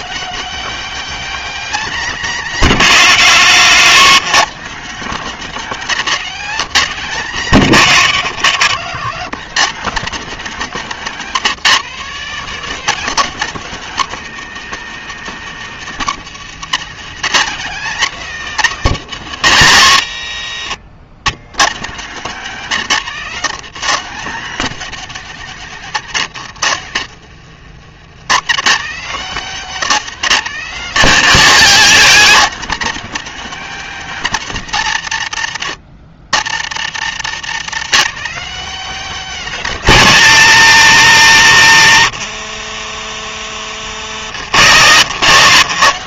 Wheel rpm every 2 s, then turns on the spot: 230, 200, 190, 180, 170, 210, 200, 230, 190, 210, 100, 170, 180, 80, 140, 160, 190, 150, 90, 210, 180, 50, 90.
8-10 12-14 20-22 26-28 42-44